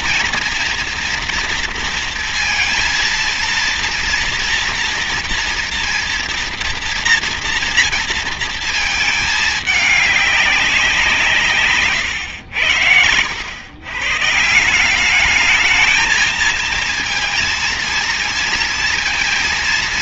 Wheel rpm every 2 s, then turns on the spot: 230, 230, 230, 230, 220, 170, 100, 190, 230, 230.
none